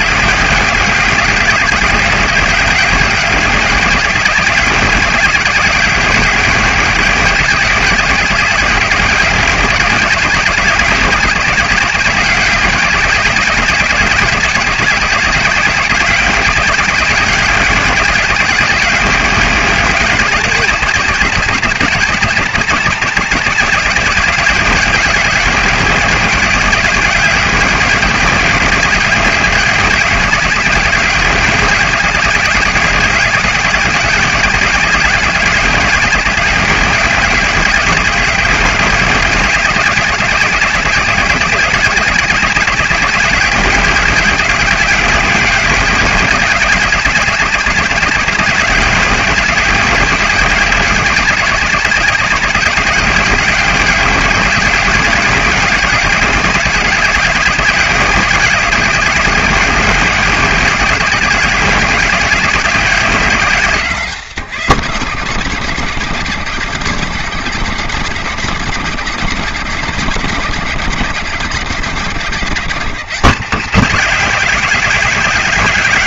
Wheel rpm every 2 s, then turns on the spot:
190, 200, 190, 190, 190, 200, 210, 210, 180, 180, 190, 210, 190, 200, 180, 190, 200, 190, 180, 200, 180, 180, 200, 210, 190, 190, 200, 200, 200, 190, 190, 190, 140, 150, 150, 160, 180, 190.
none